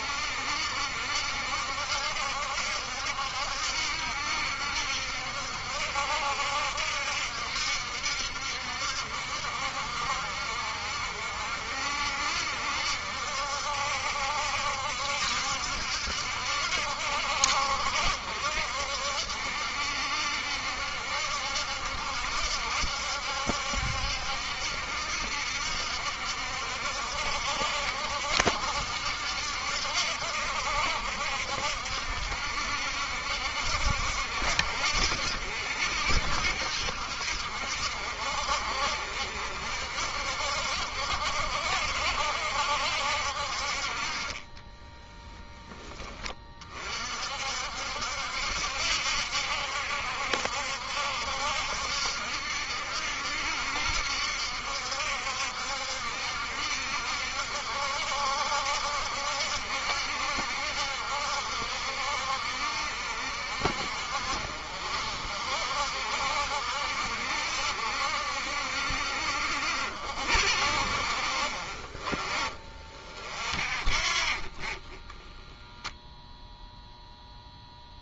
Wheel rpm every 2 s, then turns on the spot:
70, 70, 70, 70, 70, 60, 70, 70, 70, 70, 70, 70, 70, 60, 70, 70, 60, 70, 70, 60, 70, 70, 20, 40, 70, 70, 70, 70, 60, 70, 70, 60, 50, 60, 70, 60, 30, 20, 0.
44-46